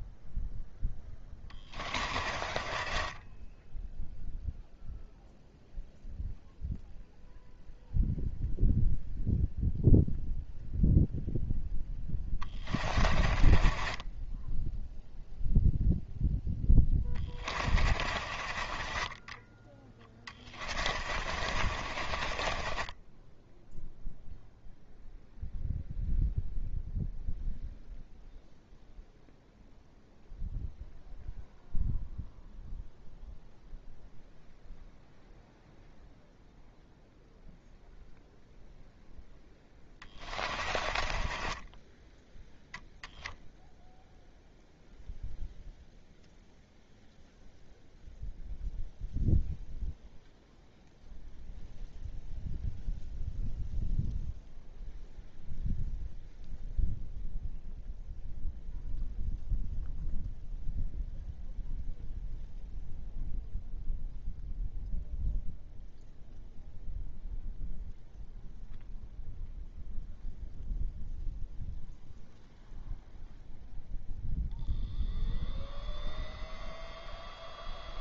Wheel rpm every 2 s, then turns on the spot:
0, 30, 0, 0, 0, 0, 20, 0, 10, 30, 30, 20, 0, 0, 0, 0, 0, 0, 0, 0, 30, 0, 0, 0, 0, 0, 0, 0, 0, 0, 0, 0, 0, 0, 0, 0, 0, 0, 0.
2-4 12-14 16-24 40-42